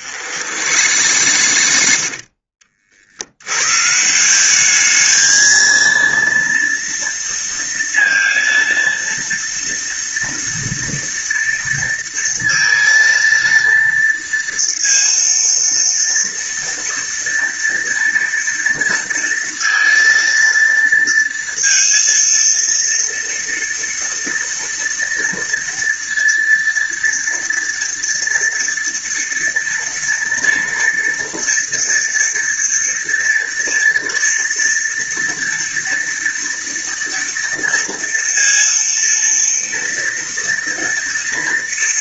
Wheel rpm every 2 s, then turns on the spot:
90, 50, 220, 230, 230, 230, 230, 230, 230, 230, 230, 230, 230, 230, 230, 230, 230, 230, 230, 230, 240.
0-2